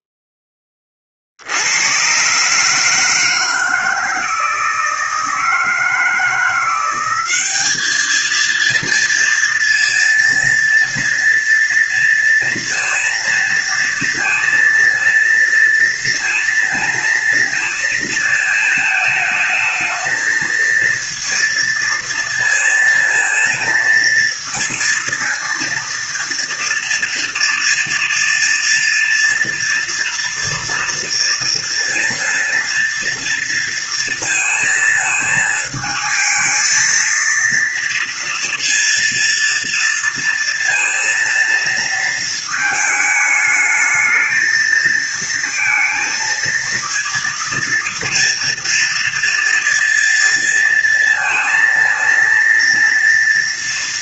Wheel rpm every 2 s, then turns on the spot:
10, 140, 160, 170, 220, 230, 230, 230, 230, 220, 220, 230, 230, 230, 230, 230, 230, 230, 220, 230, 230, 220, 220, 230, 230, 230, 230.
none